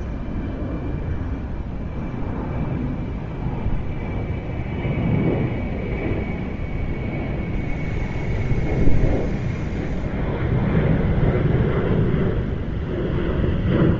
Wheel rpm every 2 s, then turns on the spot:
0, 0, 0, 0, 0, 0, 0.
none